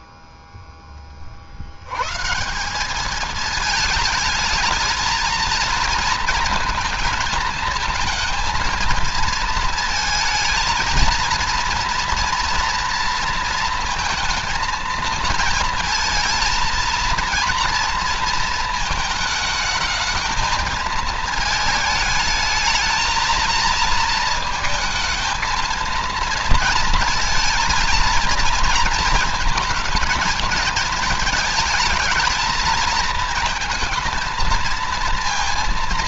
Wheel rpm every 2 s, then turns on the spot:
60, 210, 230, 230, 230, 230, 230, 220, 230, 220, 220, 220, 220, 230, 230, 220, 220, 230.
none